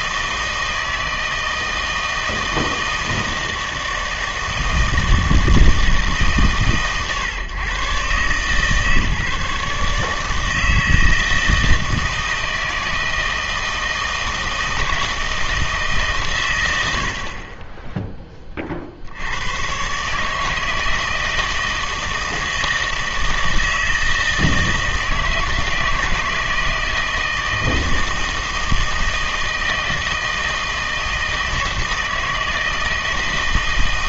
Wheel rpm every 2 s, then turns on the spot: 160, 160, 160, 130, 140, 160, 160, 160, 90, 40, 160, 160, 160, 160, 160, 160, 160.
none